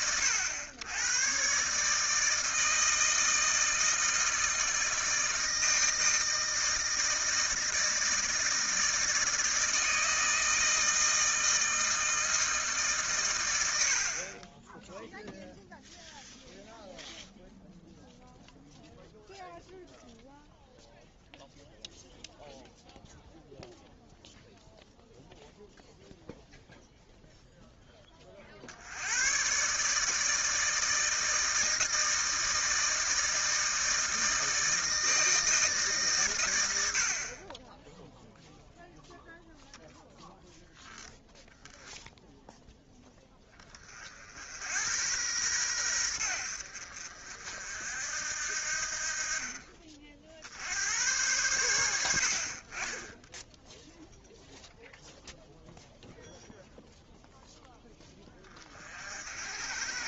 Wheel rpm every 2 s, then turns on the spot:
90, 160, 160, 160, 160, 160, 160, 20, 0, 0, 0, 0, 0, 0, 60, 160, 160, 160, 90, 0, 0, 0, 80, 70, 60, 70, 40, 0, 0, 40.
none